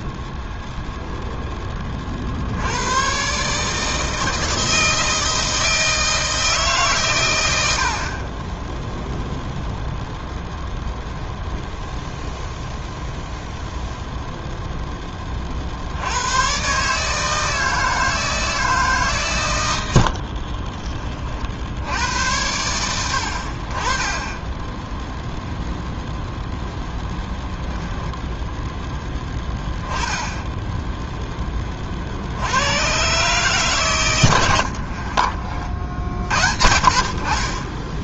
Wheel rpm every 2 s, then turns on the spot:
10, 80, 160, 140, 10, 0, 0, 0, 130, 160, 30, 90, 10, 0, 10, 0, 100, 80, 50.
20-22 34-36